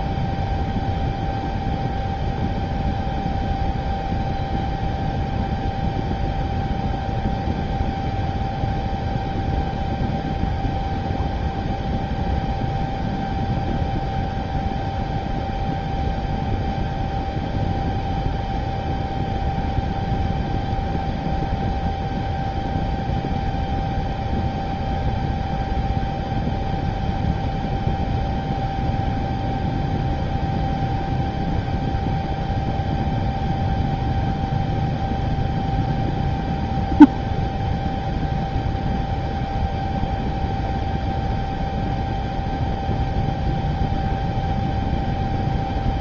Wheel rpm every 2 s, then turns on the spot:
0, 0, 0, 0, 0, 0, 0, 0, 0, 0, 0, 0, 0, 0, 0, 0, 0, 0, 0, 0, 0, 0, 0.
none